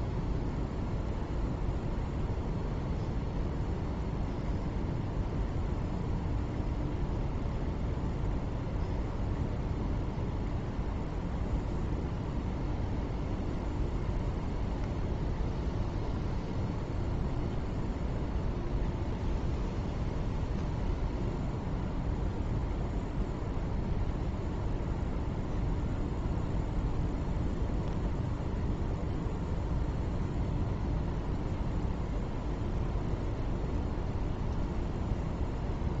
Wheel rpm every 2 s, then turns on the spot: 0, 0, 0, 0, 0, 0, 0, 0, 0, 0, 0, 0, 0, 0, 0, 0, 0, 0.
none